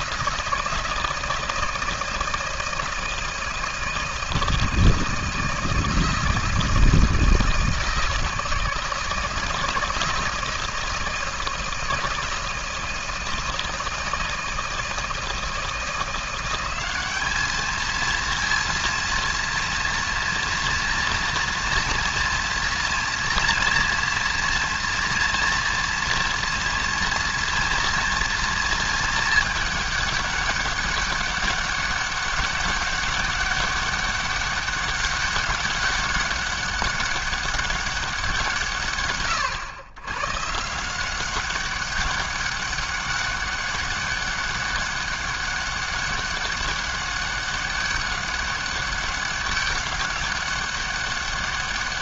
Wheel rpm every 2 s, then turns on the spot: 160, 160, 160, 160, 160, 160, 160, 160, 190, 230, 230, 230, 230, 230, 220, 200, 200, 200, 200, 150, 170, 200, 200, 200, 200, 200.
none